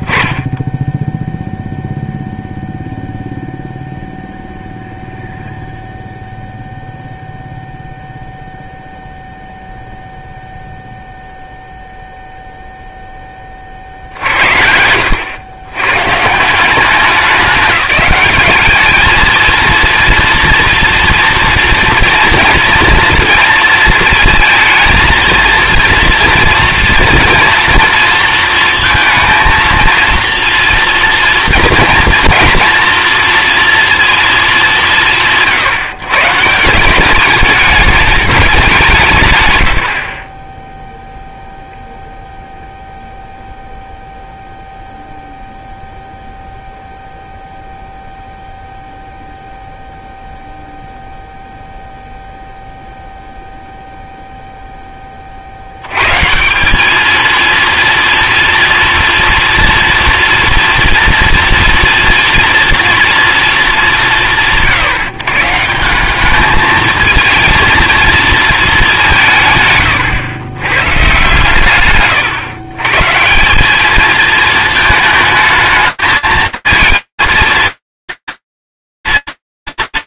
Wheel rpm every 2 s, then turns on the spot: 10, 0, 0, 0, 0, 0, 0, 70, 180, 220, 230, 230, 220, 230, 230, 240, 240, 190, 180, 180, 0, 0, 0, 0, 0, 0, 0, 0, 190, 230, 230, 230, 150, 220, 210, 140, 130, 220, 230, 230.
none